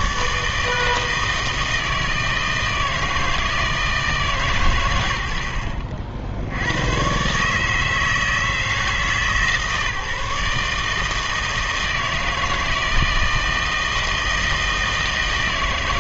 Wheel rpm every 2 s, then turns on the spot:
150, 160, 120, 100, 160, 160, 160, 160.
none